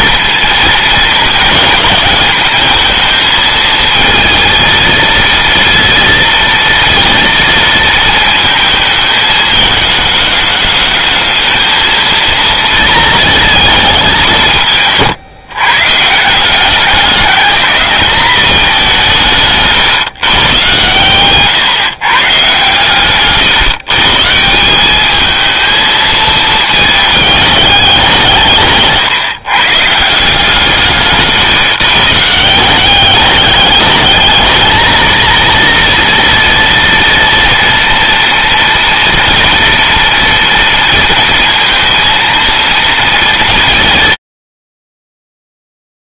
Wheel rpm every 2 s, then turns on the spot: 230, 220, 230, 230, 220, 220, 220, 160, 200, 190, 130, 130, 200, 220, 140, 160, 190, 220, 230, 240, 230, 230, 70.
20-22